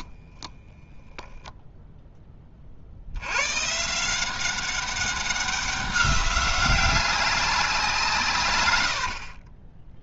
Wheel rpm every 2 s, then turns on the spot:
10, 50, 190, 200, 100.
8-10